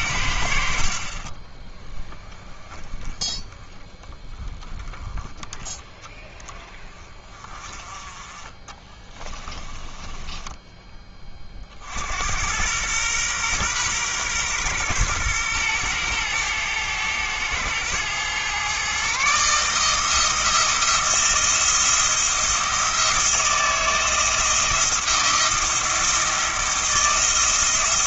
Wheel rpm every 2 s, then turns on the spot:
40, 10, 10, 20, 20, 20, 110, 120, 110, 130, 170, 170, 170, 170.
8-10